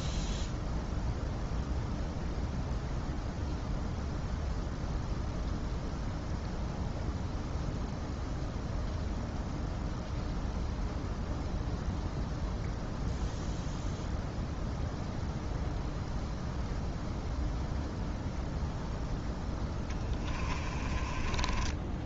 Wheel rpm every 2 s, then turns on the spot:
0, 0, 0, 0, 0, 0, 0, 0, 0, 0, 20.
20-22